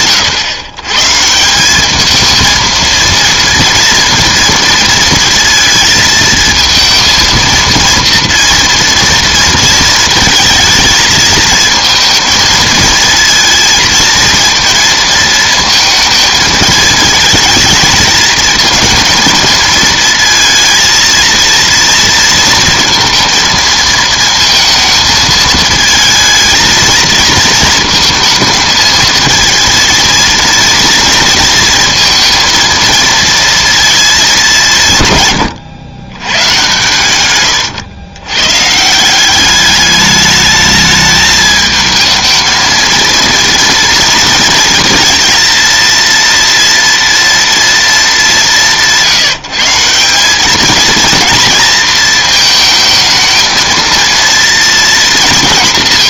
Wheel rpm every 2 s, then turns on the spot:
120, 230, 230, 220, 230, 220, 220, 230, 220, 220, 220, 230, 230, 220, 220, 230, 230, 180, 130, 130, 210, 220, 230, 230, 180, 220, 220, 230.
none